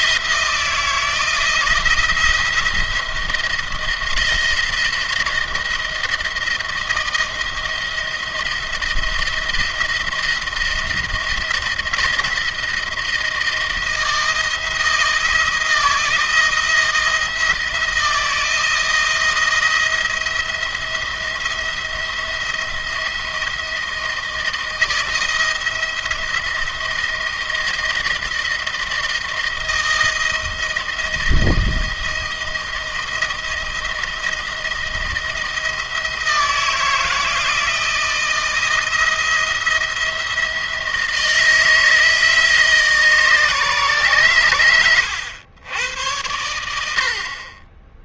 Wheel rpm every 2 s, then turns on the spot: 170, 170, 160, 170, 170, 170, 170, 170, 160, 160, 170, 170, 160, 170, 170, 160, 160, 160, 160, 170, 160, 150, 100, 70.
44-46